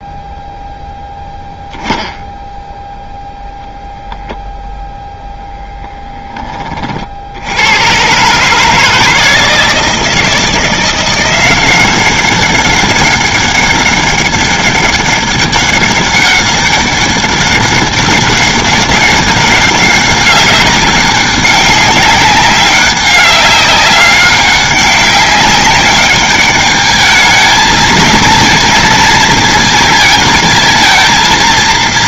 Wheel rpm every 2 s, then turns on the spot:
0, 0, 0, 30, 160, 170, 200, 200, 200, 200, 200, 200, 200, 210, 230, 220.
none